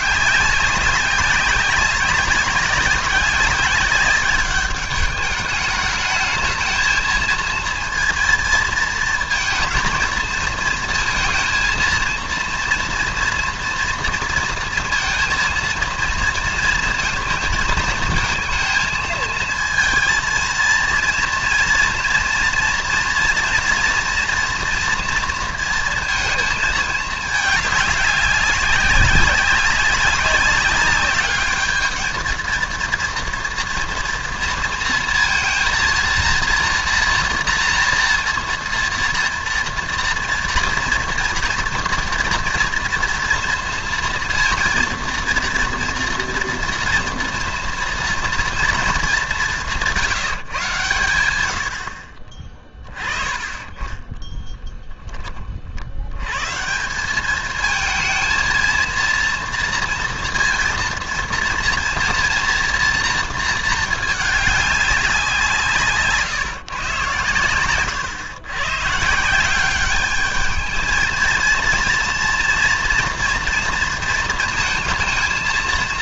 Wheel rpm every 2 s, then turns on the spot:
190, 190, 200, 220, 230, 230, 230, 230, 230, 220, 230, 230, 230, 220, 190, 200, 220, 230, 230, 230, 230, 230, 230, 240, 230, 150, 20, 0, 150, 220, 230, 230, 210, 150, 120, 220, 240, 230.
none